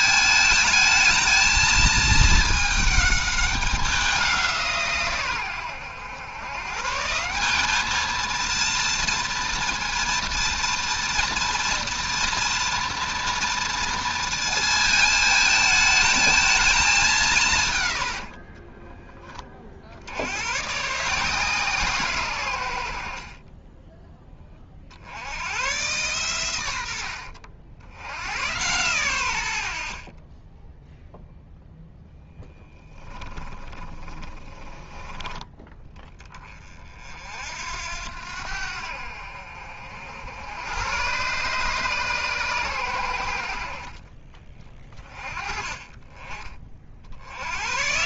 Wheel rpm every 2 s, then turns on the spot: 220, 210, 160, 140, 230, 230, 230, 220, 210, 20, 130, 90, 40, 100, 110, 10, 10, 20, 30, 70, 110, 120, 20, 40.
18-20 32-34